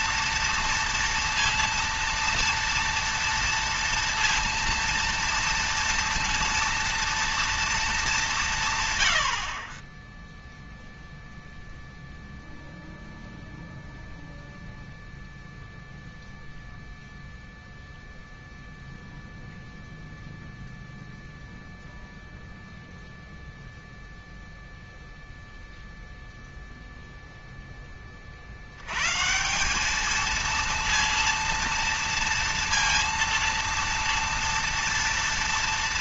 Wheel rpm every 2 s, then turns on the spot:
230, 230, 230, 230, 140, 0, 0, 0, 0, 0, 0, 0, 0, 0, 70, 230, 230, 230.
none